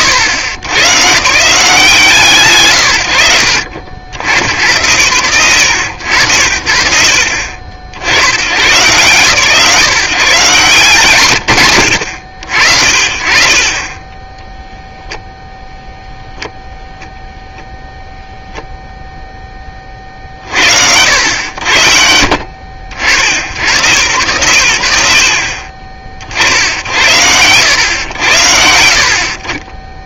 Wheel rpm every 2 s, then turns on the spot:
120, 110, 90, 70, 110, 130, 60, 0, 0, 0, 60, 70, 90, 70, 60.
none